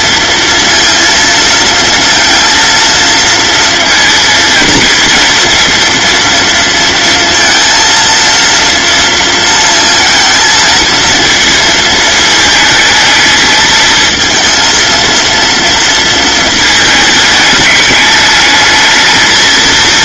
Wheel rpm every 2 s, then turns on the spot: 230, 230, 230, 230, 230, 230, 220, 230, 220, 220.
none